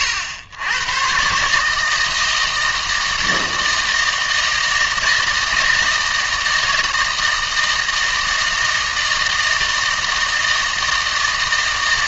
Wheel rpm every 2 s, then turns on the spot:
100, 160, 160, 160, 160, 160.
none